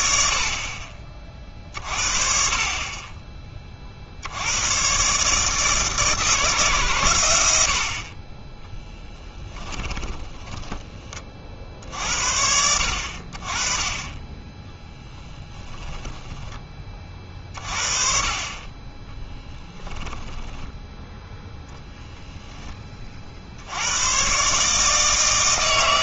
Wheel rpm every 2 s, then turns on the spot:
50, 40, 100, 150, 20, 20, 70, 20, 20, 30, 10, 10, 140.
8-12 20-22